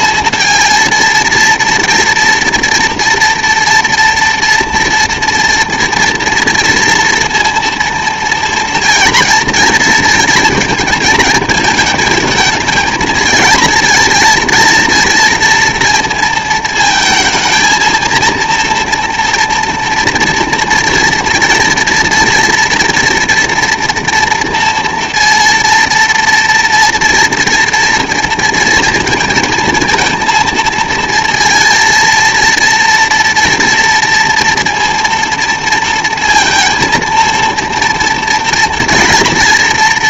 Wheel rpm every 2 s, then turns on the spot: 230, 230, 230, 230, 230, 230, 220, 230, 220, 230, 230, 230, 230, 230, 230, 230, 230, 230, 230, 230.
none